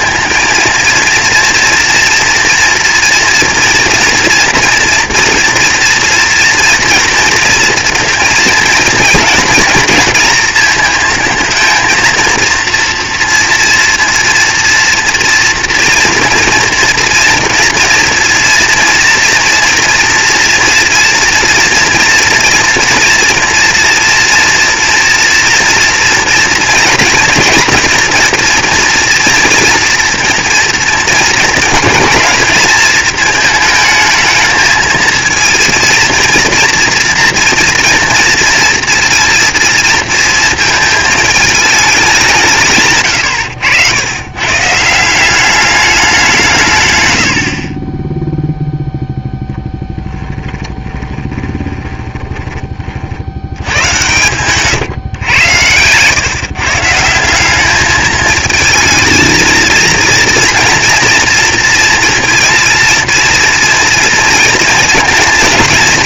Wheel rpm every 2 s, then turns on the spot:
230, 230, 230, 230, 230, 230, 230, 230, 230, 230, 240, 230, 230, 230, 240, 230, 210, 220, 230, 230, 220, 160, 120, 160, 0, 10, 30, 130, 140, 220, 230, 230, 230.
50-52